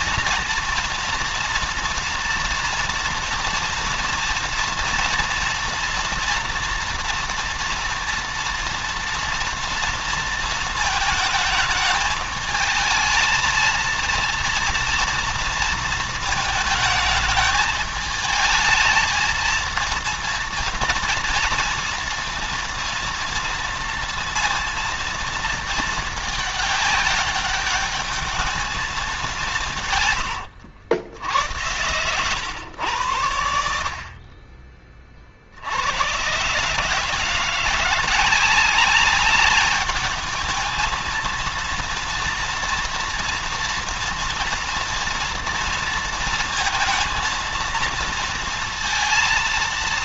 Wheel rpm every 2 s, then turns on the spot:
230, 230, 230, 230, 230, 220, 220, 230, 220, 220, 230, 230, 230, 200, 210, 90, 110, 30, 150, 200, 220, 230, 240, 230, 230.
none